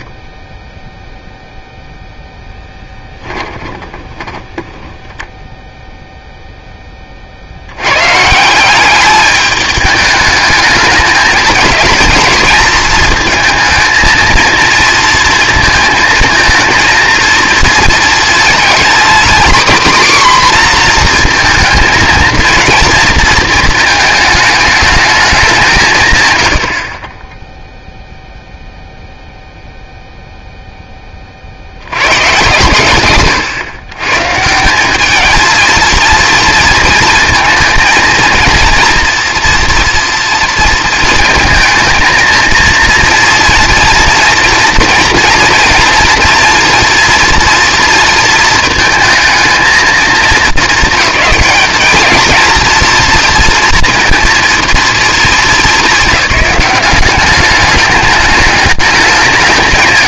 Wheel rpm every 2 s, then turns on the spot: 10, 10, 10, 10, 180, 210, 230, 220, 220, 230, 250, 230, 220, 70, 0, 0, 120, 170, 230, 230, 230, 230, 230, 240, 230, 220, 230, 230, 190, 210.
2-4